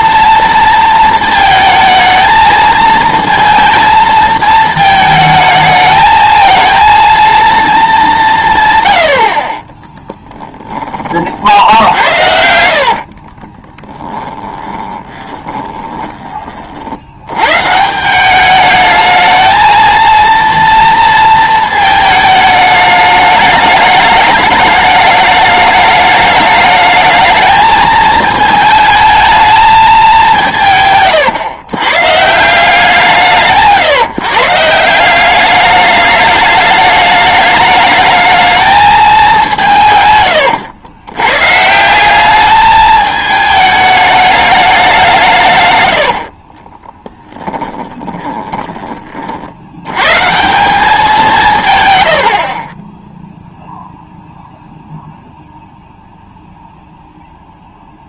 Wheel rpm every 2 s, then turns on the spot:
230, 220, 220, 230, 130, 20, 70, 20, 50, 210, 230, 210, 210, 210, 220, 160, 170, 160, 210, 220, 100, 210, 200, 30, 20, 190, 30, 0, 0.
12-16 46-48